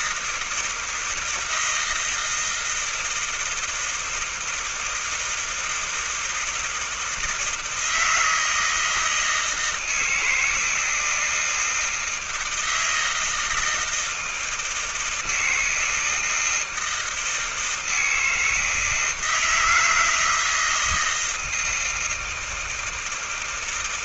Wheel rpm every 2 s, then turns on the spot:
160, 160, 160, 160, 160, 160, 160, 160, 170, 160, 160, 160.
none